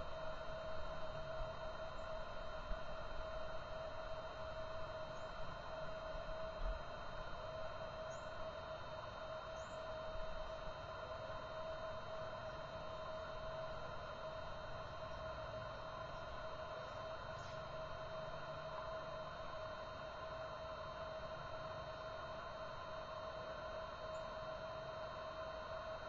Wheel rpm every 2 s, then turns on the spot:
0, 0, 0, 0, 0, 0, 0, 0, 0, 0, 0, 0, 0.
none